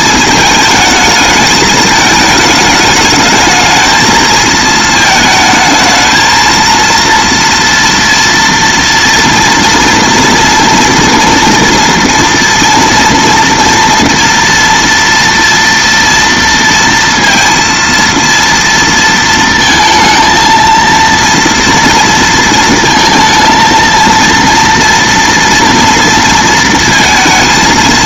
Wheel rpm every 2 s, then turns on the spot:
220, 220, 220, 230, 230, 230, 230, 230, 230, 230, 230, 230, 230, 230.
none